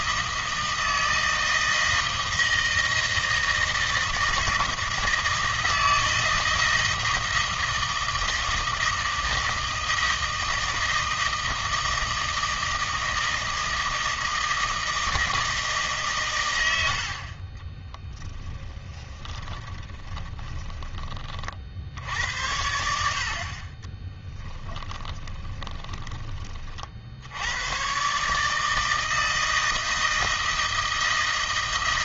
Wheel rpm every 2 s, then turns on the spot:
160, 160, 160, 160, 160, 160, 160, 160, 100, 10, 20, 80, 20, 40, 160, 160.
18-22 24-26